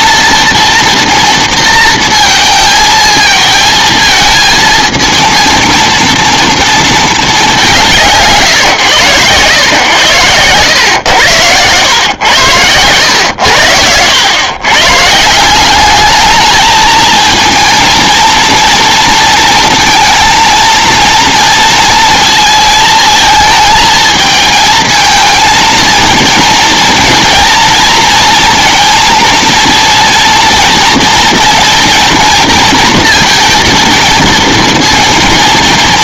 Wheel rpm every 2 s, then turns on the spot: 230, 230, 220, 230, 150, 100, 100, 120, 210, 230, 230, 230, 220, 230, 230, 230, 230, 230.
none